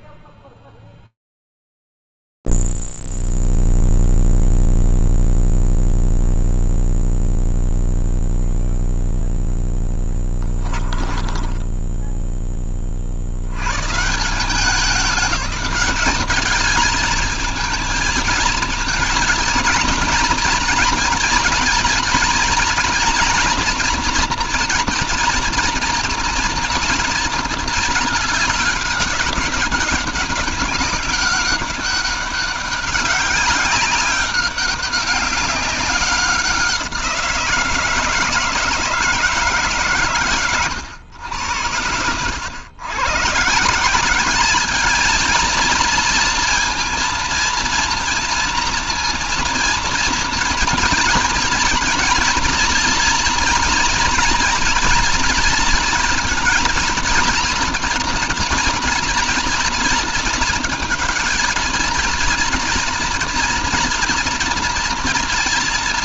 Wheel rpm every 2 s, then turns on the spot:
0, 0, 0, 0, 0, 10, 10, 170, 210, 220, 230, 230, 230, 230, 210, 200, 200, 200, 180, 160, 130, 110, 210, 230, 230, 230, 230, 240, 230, 230, 220, 230, 230.
10-12